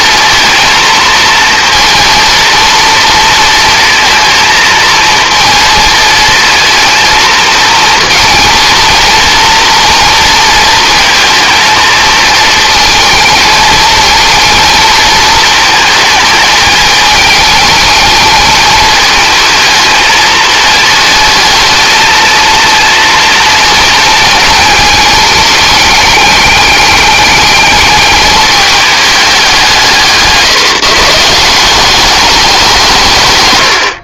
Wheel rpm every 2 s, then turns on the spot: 230, 230, 230, 230, 230, 230, 230, 230, 220, 220, 220, 230, 220, 200, 210, 160, 180.
none